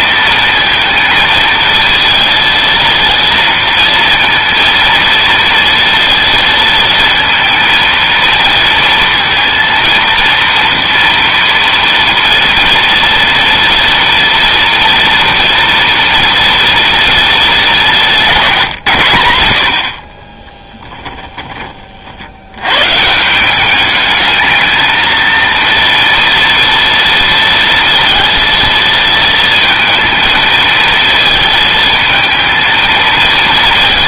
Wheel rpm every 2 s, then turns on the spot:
230, 230, 230, 230, 230, 230, 230, 230, 230, 120, 10, 130, 220, 230, 230, 220, 220.
20-22